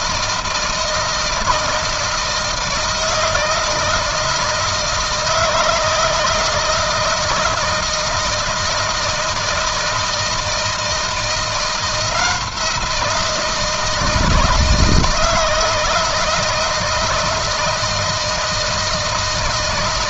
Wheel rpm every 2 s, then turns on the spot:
160, 160, 160, 160, 160, 160, 170, 160, 160, 160.
none